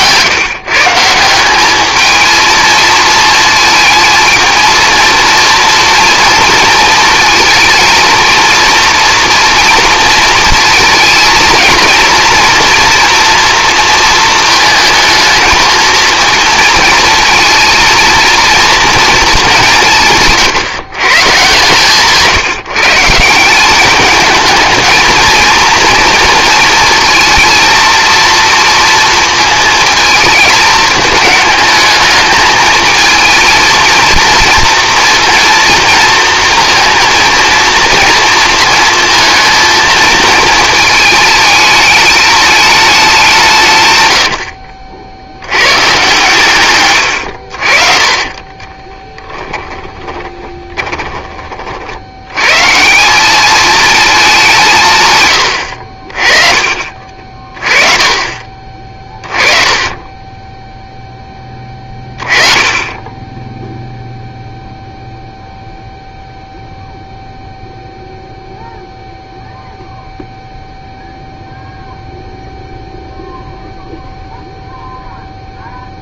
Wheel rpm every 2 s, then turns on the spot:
150, 220, 230, 230, 230, 230, 230, 220, 230, 230, 140, 160, 220, 230, 230, 220, 220, 230, 230, 230, 220, 200, 50, 120, 20, 20, 160, 150, 40, 30, 0, 20, 0, 0, 0, 0, 0, 0.
48-52